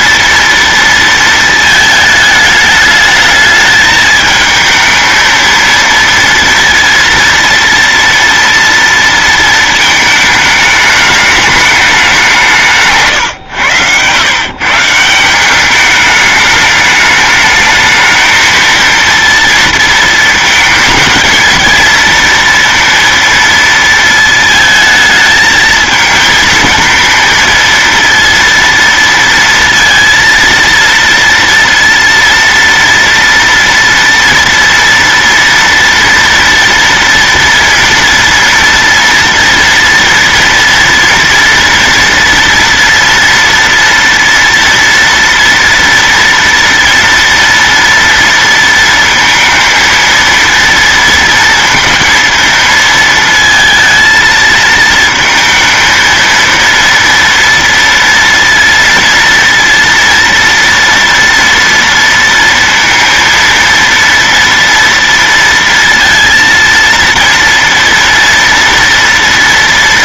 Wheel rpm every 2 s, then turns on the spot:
230, 210, 220, 230, 230, 210, 160, 160, 210, 230, 220, 230, 220, 220, 230, 230, 230, 230, 230, 230, 230, 230, 230, 230, 230, 230, 230, 220, 230, 230, 230, 230, 230, 230, 230.
none